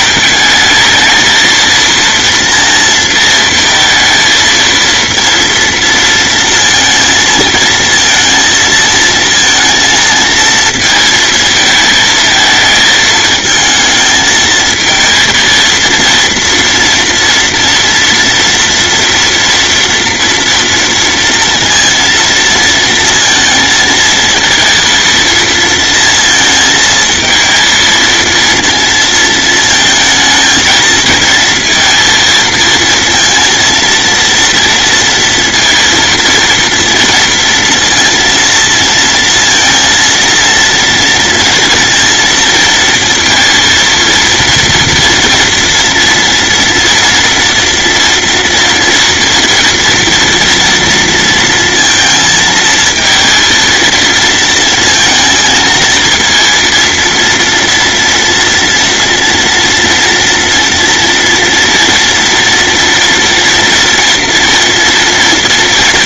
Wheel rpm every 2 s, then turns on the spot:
220, 230, 230, 230, 230, 220, 220, 230, 230, 230, 230, 230, 230, 220, 230, 230, 230, 230, 230, 230, 230, 230, 230, 240, 240, 230, 230, 230, 230, 230, 230, 230, 230.
none